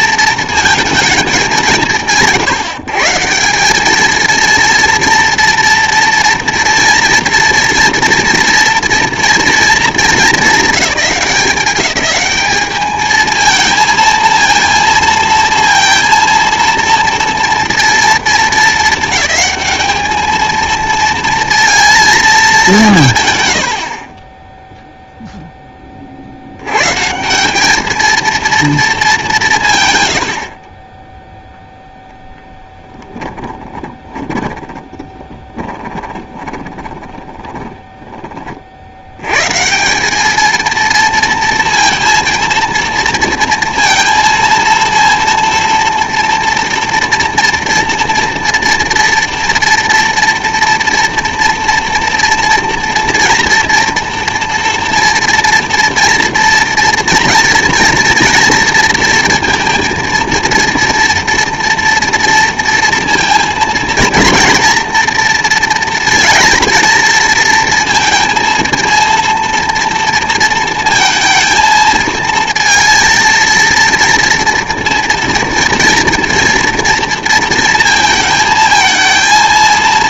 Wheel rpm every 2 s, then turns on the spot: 230, 150, 230, 230, 230, 210, 210, 230, 230, 220, 230, 190, 0, 100, 220, 30, 10, 20, 20, 60, 230, 230, 230, 240, 230, 230, 230, 230, 230, 230, 230, 230, 230, 230, 230, 230, 230, 230, 230, 220.
32-38